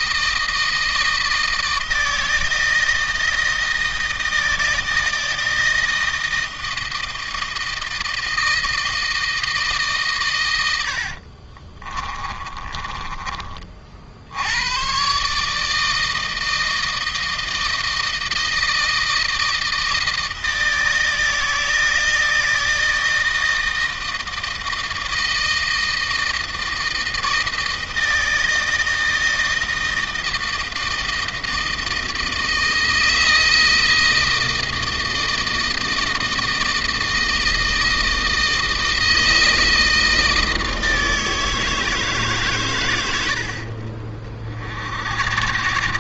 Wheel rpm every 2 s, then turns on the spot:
160, 160, 160, 160, 160, 70, 30, 120, 160, 160, 160, 160, 160, 160, 160, 160, 160, 160, 160, 160, 160, 100, 50.
10-14 42-44